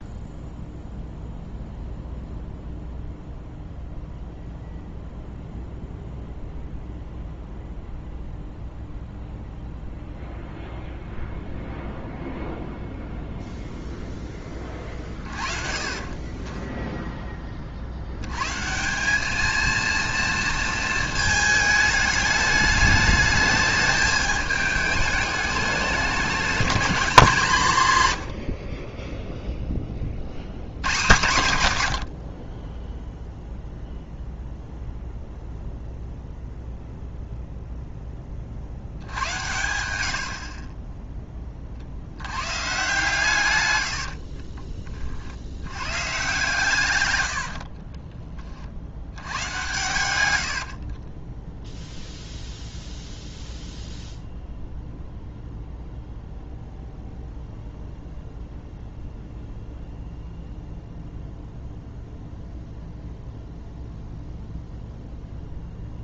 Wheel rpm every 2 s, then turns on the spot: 0, 0, 0, 0, 0, 0, 0, 30, 10, 160, 230, 210, 210, 210, 40, 100, 20, 0, 0, 50, 40, 130, 30, 120, 60, 80, 0, 0, 0, 0, 0, 0, 0.
28-30 40-42 50-52